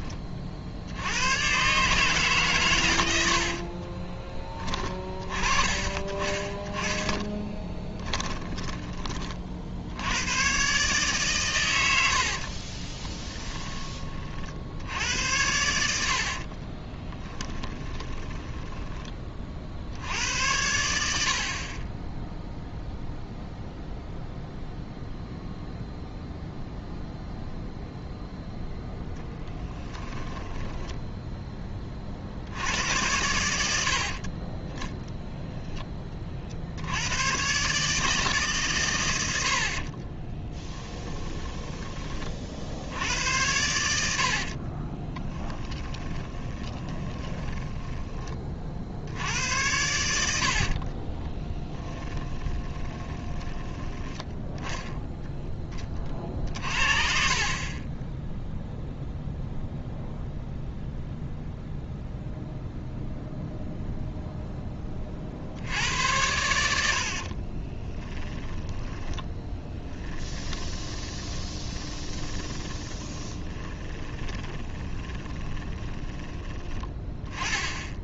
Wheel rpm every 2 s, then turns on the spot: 60, 110, 20, 10, 20, 130, 30, 70, 30, 10, 80, 0, 0, 0, 0, 10, 80, 10, 80, 120, 20, 70, 40, 20, 50, 40, 30, 0, 70, 0, 0, 0, 20, 70, 10, 20, 20, 20, 10.
12-14 16-20 30-32 40-42 44-48 50-54 68-76